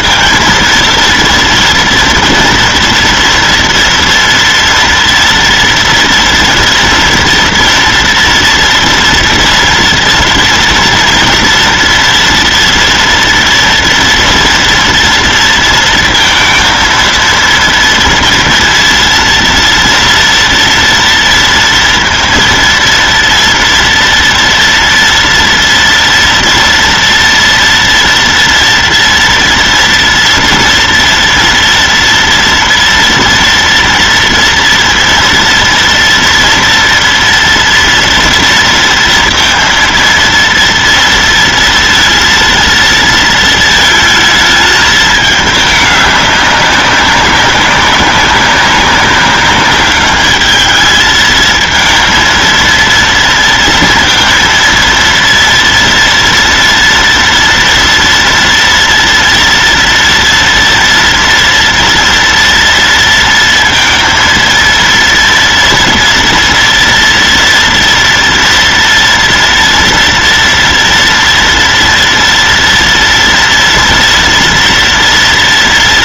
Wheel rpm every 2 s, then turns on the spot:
230, 230, 230, 230, 230, 240, 230, 230, 230, 230, 230, 230, 230, 240, 230, 240, 230, 230, 230, 230, 230, 230, 220, 200, 190, 210, 230, 230, 230, 230, 230, 230, 230, 230, 230, 230, 230, 230.
none